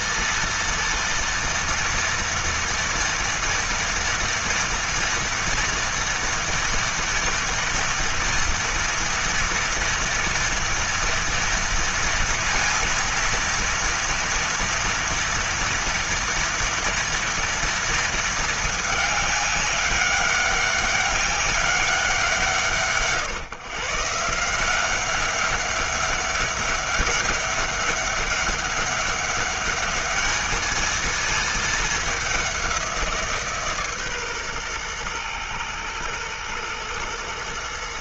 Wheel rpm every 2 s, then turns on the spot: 230, 230, 230, 230, 230, 230, 230, 230, 230, 210, 200, 140, 190, 200, 200, 220, 170, 120, 120.
none